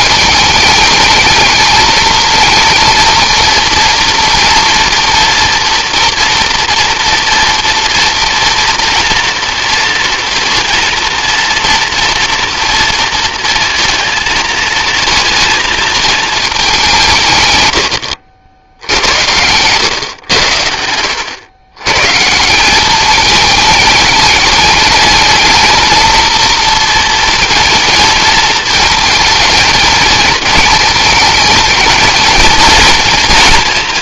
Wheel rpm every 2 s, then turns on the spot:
220, 230, 230, 230, 230, 230, 230, 230, 180, 90, 80, 200, 210, 230, 220, 220, 230.
none